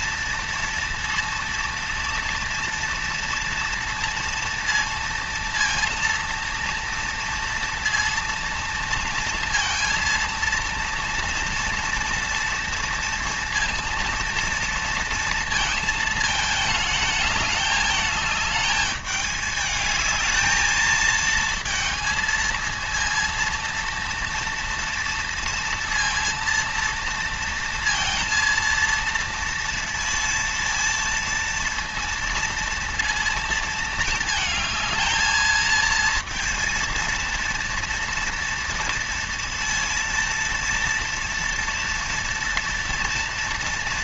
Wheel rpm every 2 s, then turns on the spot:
230, 230, 230, 230, 230, 230, 230, 230, 220, 220, 220, 230, 230, 230, 230, 230, 230, 220, 230, 230, 230, 240.
none